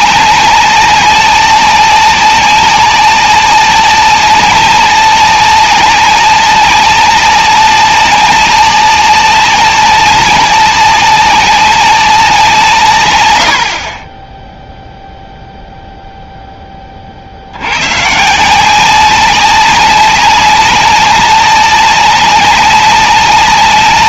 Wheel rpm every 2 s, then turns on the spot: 190, 190, 190, 190, 200, 190, 160, 0, 20, 180, 200, 190.
none